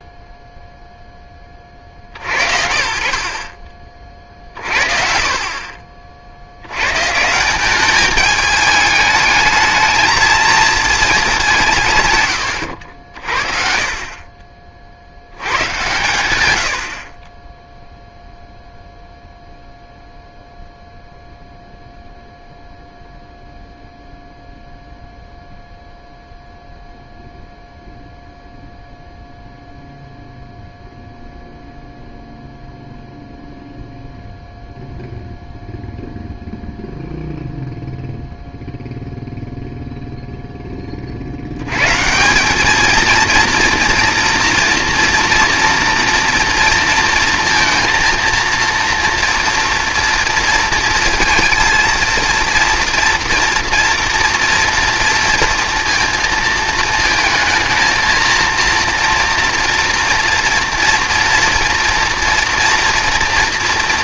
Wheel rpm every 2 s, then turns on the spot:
0, 50, 40, 100, 210, 220, 70, 40, 70, 0, 0, 0, 0, 0, 0, 0, 0, 0, 0, 0, 20, 210, 230, 230, 230, 230, 230, 230, 220, 230, 240, 230.
2-4